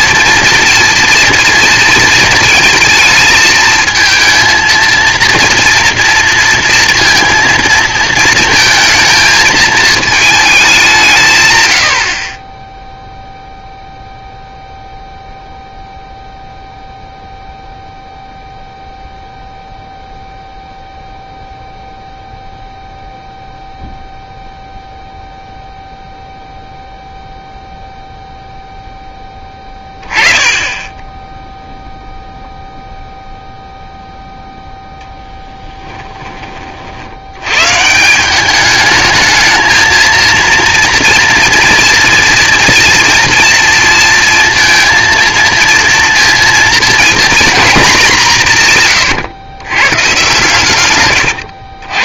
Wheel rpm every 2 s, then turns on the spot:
230, 230, 230, 230, 220, 190, 0, 0, 0, 0, 0, 0, 0, 0, 0, 10, 0, 0, 40, 200, 230, 230, 230, 240, 140, 130.
none